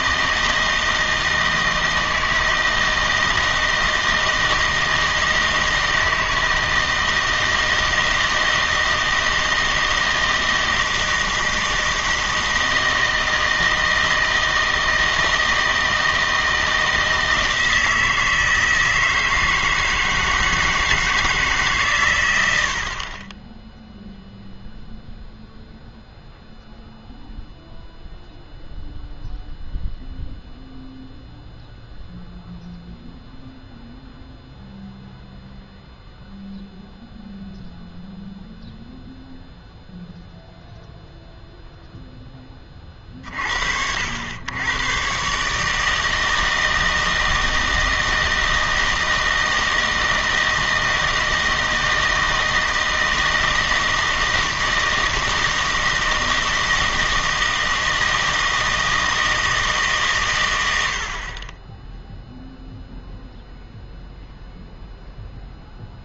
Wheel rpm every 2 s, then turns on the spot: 160, 160, 160, 160, 160, 160, 160, 160, 160, 160, 160, 80, 0, 0, 0, 0, 0, 0, 0, 0, 0, 20, 100, 160, 160, 160, 160, 160, 160, 160, 110, 0, 0.
none